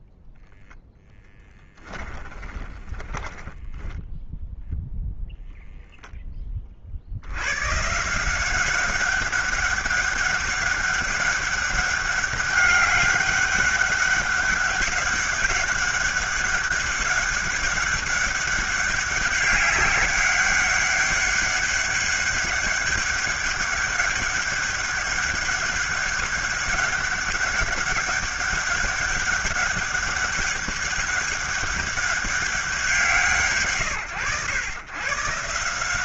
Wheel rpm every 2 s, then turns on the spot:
0, 20, 0, 30, 180, 200, 200, 200, 200, 190, 200, 200, 200, 200, 200, 200, 200, 110.
2-4